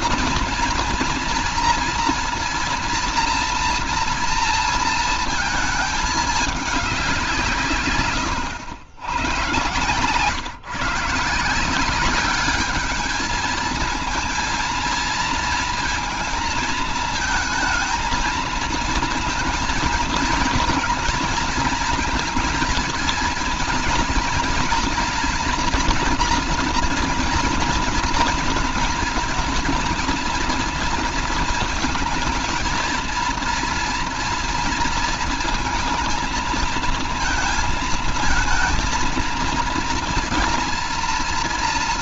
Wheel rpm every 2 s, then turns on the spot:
230, 240, 230, 170, 100, 150, 210, 230, 220, 230, 230, 230, 240, 230, 220, 230, 230, 230, 230, 230, 230.
none